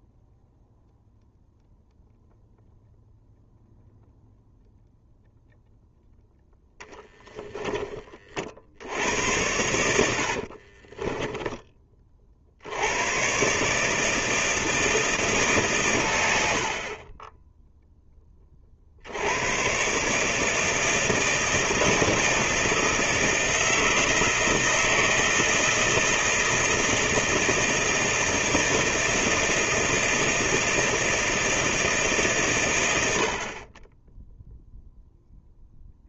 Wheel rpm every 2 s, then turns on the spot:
0, 0, 0, 0, 60, 50, 60, 160, 80, 30, 160, 160, 160, 160, 160, 160, 120, 10.
10-12